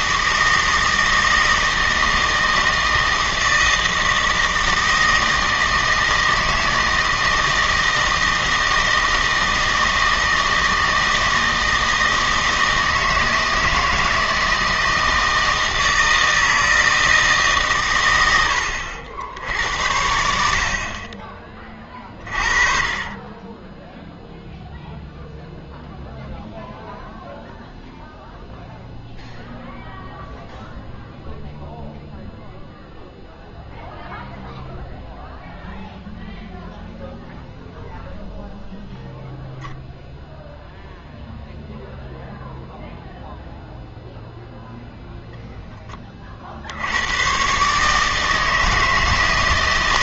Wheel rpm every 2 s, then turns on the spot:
160, 160, 160, 160, 160, 160, 160, 160, 160, 90, 50, 40, 0, 0, 0, 0, 0, 0, 0, 0, 0, 0, 0, 70, 160.
none